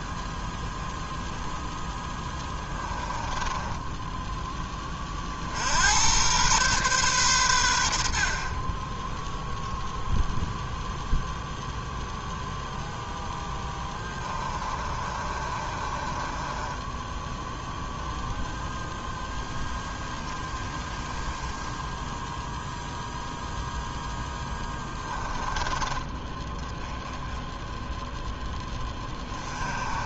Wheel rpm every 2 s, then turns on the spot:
10, 20, 30, 120, 10, 0, 0, 40, 0, 0, 10, 0, 20, 10, 20.
2-4 14-16